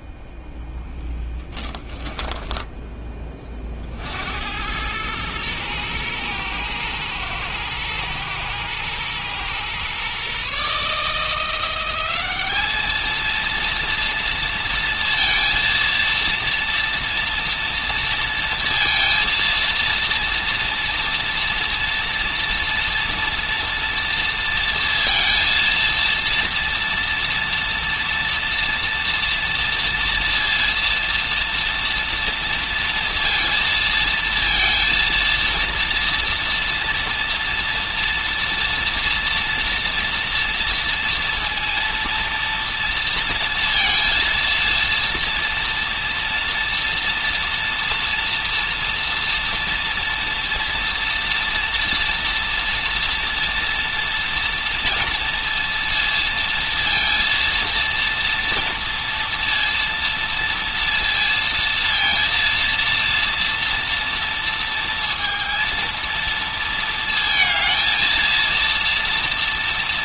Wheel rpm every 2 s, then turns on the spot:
0, 10, 100, 120, 120, 140, 210, 230, 230, 230, 230, 230, 230, 230, 230, 230, 230, 230, 230, 230, 230, 230, 230, 230, 230, 230, 240, 230, 230, 230, 230, 230, 230, 230, 230.
2-4